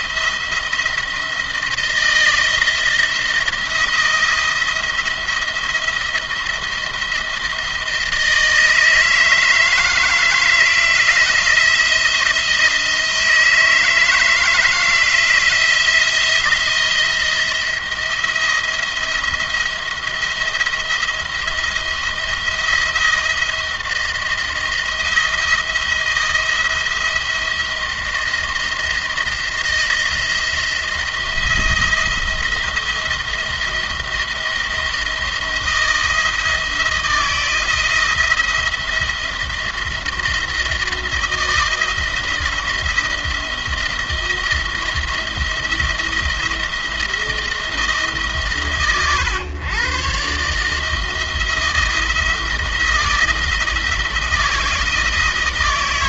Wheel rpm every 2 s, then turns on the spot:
170, 160, 170, 170, 160, 160, 170, 160, 170, 170, 170, 170, 170, 170, 170, 170, 170, 170, 170, 170, 170, 170, 170, 170, 130, 140, 160, 170.
none